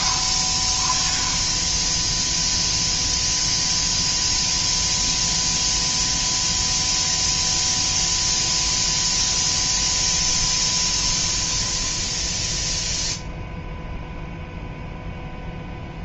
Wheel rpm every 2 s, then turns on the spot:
40, 0, 0, 0, 0, 10, 0, 0.
10-12